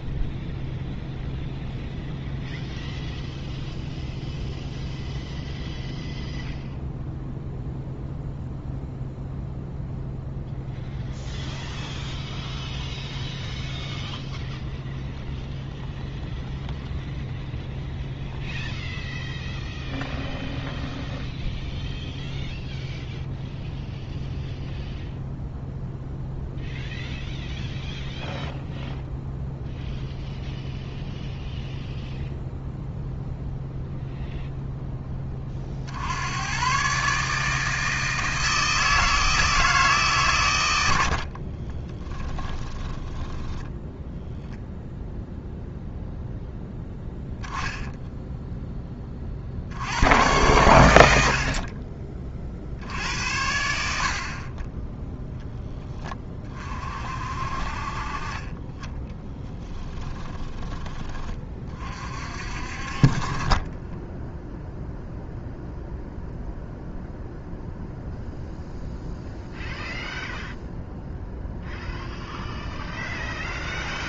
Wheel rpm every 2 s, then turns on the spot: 0, 0, 0, 0, 0, 0, 0, 0, 0, 0, 0, 0, 0, 0, 0, 0, 0, 0, 130, 160, 90, 10, 0, 0, 20, 100, 70, 10, 40, 20, 20, 40, 0, 0, 0, 0, 0.
42-44